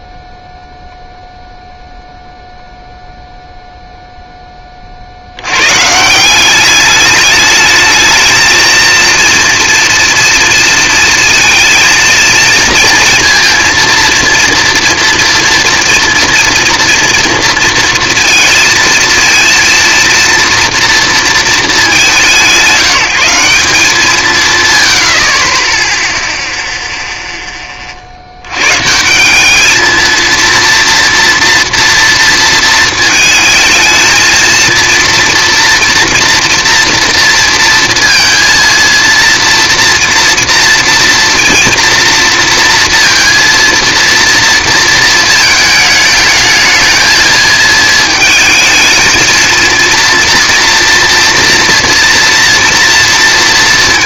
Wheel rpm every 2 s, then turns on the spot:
0, 0, 30, 200, 230, 230, 230, 230, 230, 230, 230, 180, 120, 0, 120, 230, 230, 230, 230, 230, 230, 230, 230, 220, 220, 240, 230.
none